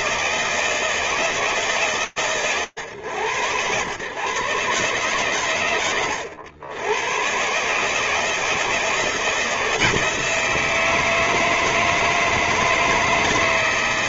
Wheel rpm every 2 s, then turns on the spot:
160, 110, 120, 110, 160, 160, 160.
none